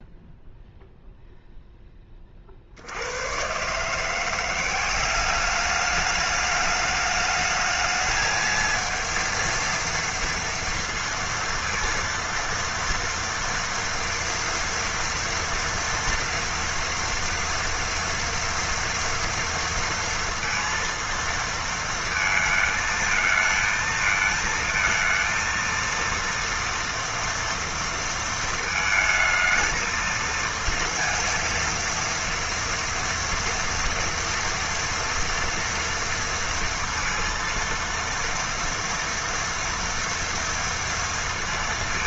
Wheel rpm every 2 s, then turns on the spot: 0, 50, 180, 210, 230, 230, 230, 230, 230, 230, 230, 220, 230, 230, 220, 230, 230, 230, 230, 230, 230.
none